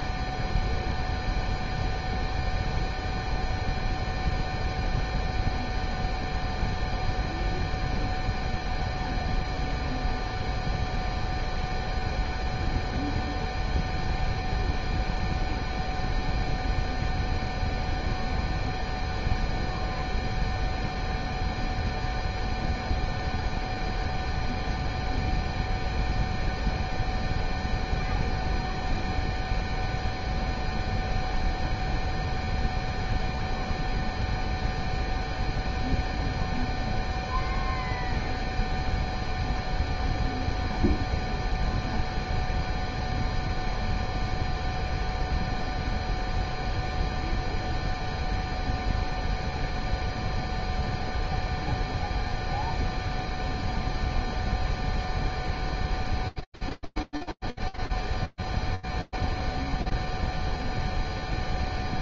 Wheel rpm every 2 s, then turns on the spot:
0, 0, 0, 0, 0, 0, 0, 0, 0, 0, 0, 0, 0, 0, 0, 0, 0, 0, 0, 0, 0, 0, 0, 0, 0, 0, 0, 0, 0, 0, 0.
none